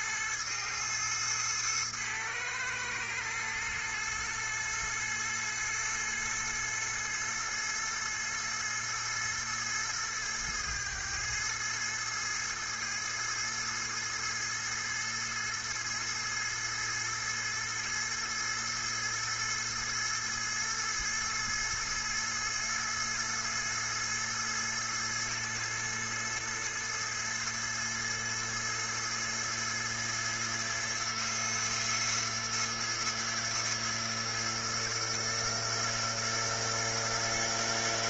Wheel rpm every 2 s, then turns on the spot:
110, 110, 110, 110, 110, 110, 110, 110, 110, 110, 110, 110, 110, 110, 110, 110, 110, 120, 120.
none